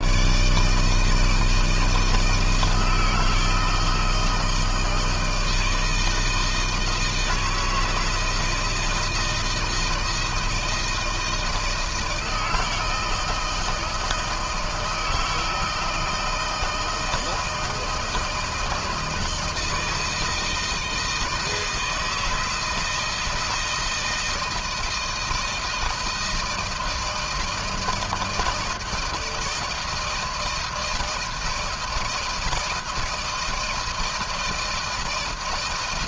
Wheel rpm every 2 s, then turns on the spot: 140, 160, 160, 160, 160, 160, 160, 160, 160, 160, 160, 160, 160, 160, 160, 160, 160, 160.
none